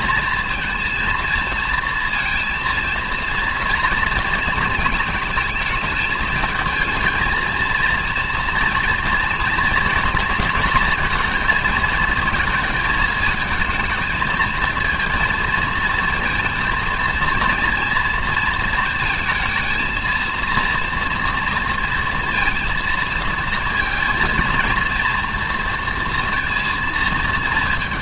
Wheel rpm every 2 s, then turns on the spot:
230, 230, 220, 220, 240, 230, 220, 230, 230, 230, 230, 230, 230, 230.
none